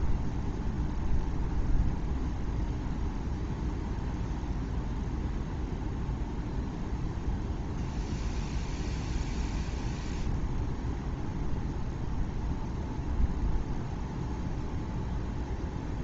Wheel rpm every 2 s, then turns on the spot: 0, 0, 0, 0, 0, 0, 0, 0.
none